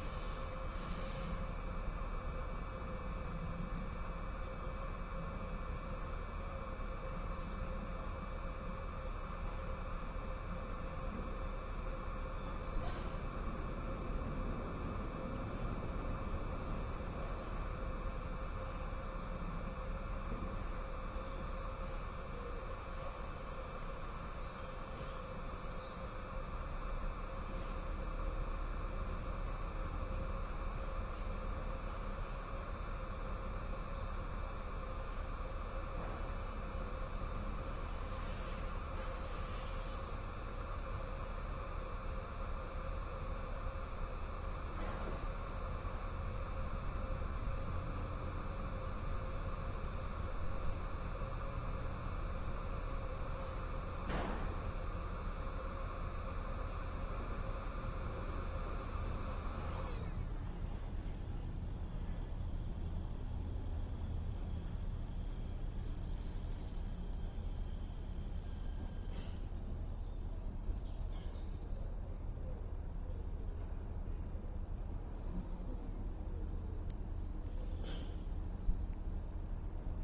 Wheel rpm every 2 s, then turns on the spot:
0, 0, 0, 0, 0, 0, 0, 0, 0, 0, 0, 0, 0, 0, 0, 0, 0, 0, 0, 0, 0, 0, 0, 0, 0, 0, 0, 0, 0, 0, 0, 0, 0, 0, 0, 0, 0, 0, 0, 0.
none